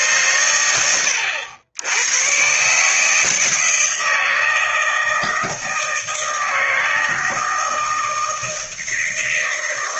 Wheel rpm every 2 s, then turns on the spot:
100, 140, 160, 160, 160.
none